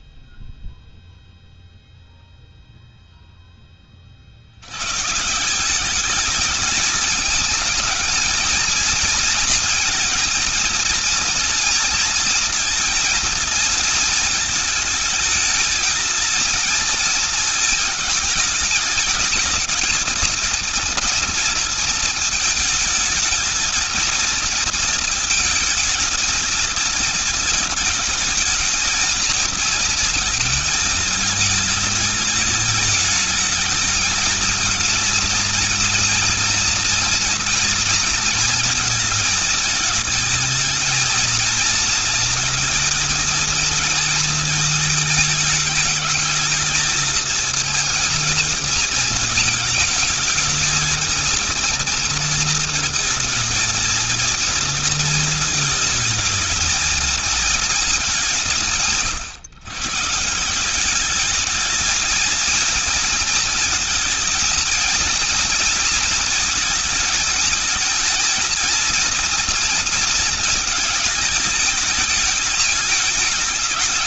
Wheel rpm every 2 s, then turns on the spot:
0, 0, 100, 220, 230, 230, 230, 220, 230, 220, 230, 220, 230, 220, 220, 220, 210, 230, 230, 230, 220, 230, 220, 220, 220, 220, 230, 230, 220, 160, 190, 230, 220, 220, 220, 220, 220.
none